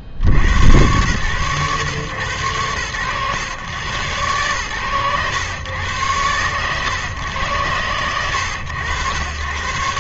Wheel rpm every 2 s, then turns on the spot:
70, 110, 110, 110, 100.
none